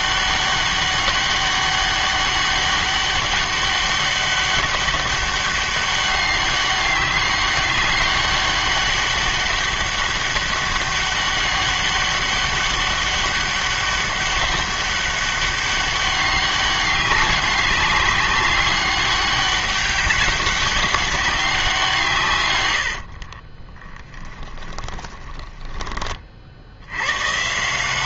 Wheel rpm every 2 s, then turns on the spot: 200, 200, 200, 200, 200, 200, 200, 200, 200, 200, 200, 100, 20, 80.
24-26